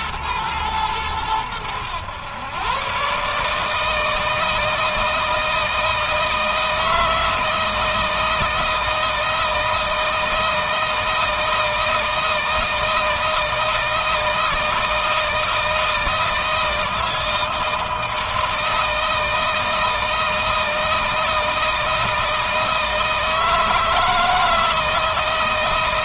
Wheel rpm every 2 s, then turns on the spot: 110, 120, 160, 160, 160, 160, 160, 160, 160, 160, 160, 160, 160.
none